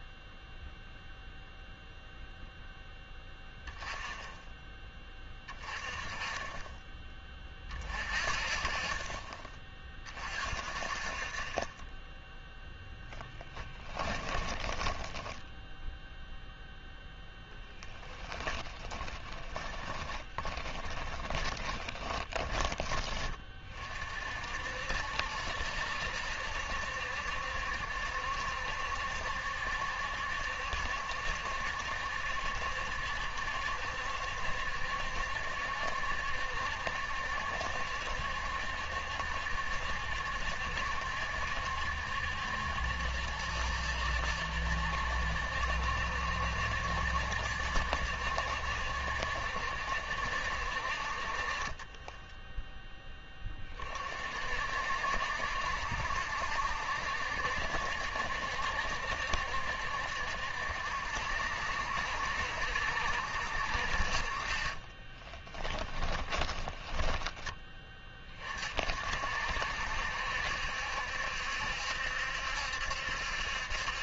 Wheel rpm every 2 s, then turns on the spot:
0, 0, 10, 20, 40, 40, 0, 20, 0, 10, 20, 20, 60, 70, 70, 70, 70, 70, 70, 70, 70, 70, 70, 70, 70, 60, 10, 60, 70, 70, 70, 70, 30, 20, 40, 70, 70.
14-16 18-22 64-68